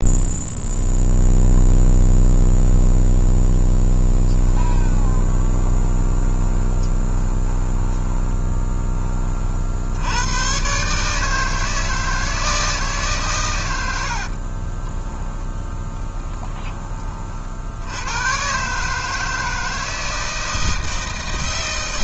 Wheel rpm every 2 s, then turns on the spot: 0, 0, 20, 20, 10, 130, 160, 30, 20, 140, 160.
4-8 14-16